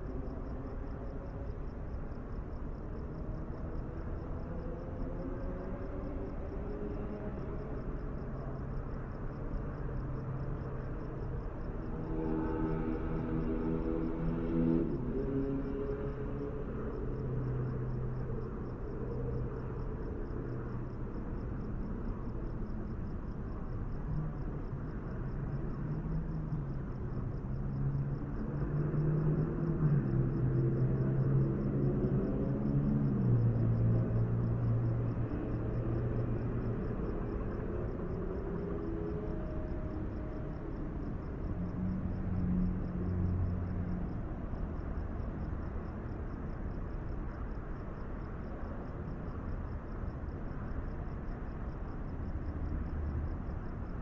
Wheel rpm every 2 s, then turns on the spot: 0, 0, 0, 0, 0, 0, 0, 0, 0, 0, 0, 0, 0, 0, 0, 0, 0, 0, 0, 0, 0, 0, 0, 0, 0, 0, 0.
none